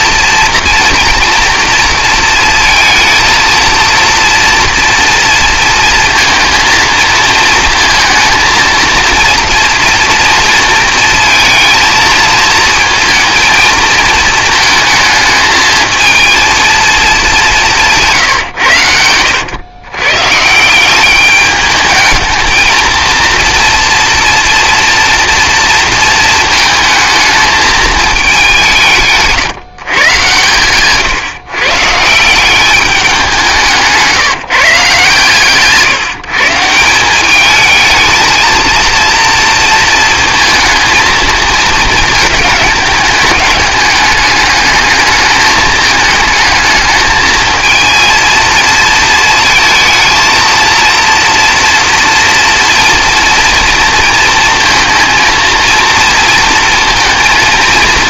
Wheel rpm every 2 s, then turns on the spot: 230, 230, 230, 220, 220, 230, 220, 220, 230, 120, 170, 230, 230, 230, 190, 120, 200, 160, 170, 230, 220, 210, 210, 220, 230, 230, 230, 230, 230.
none